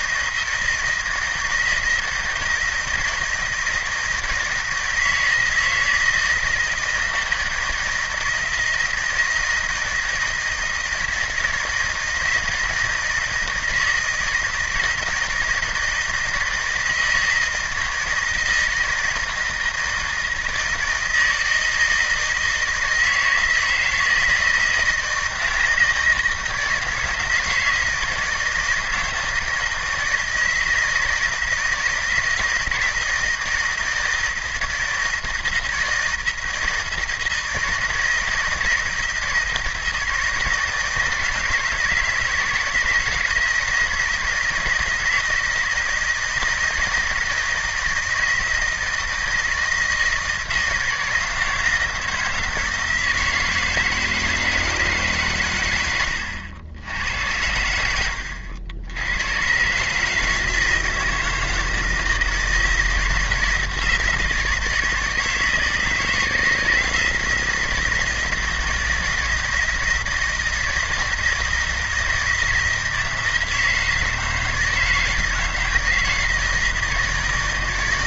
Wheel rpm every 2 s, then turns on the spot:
160, 160, 160, 160, 160, 160, 160, 160, 160, 160, 160, 160, 160, 160, 160, 160, 160, 160, 160, 160, 160, 160, 160, 160, 160, 170, 160, 160, 90, 80, 160, 160, 160, 160, 170, 160, 160, 160, 160.
none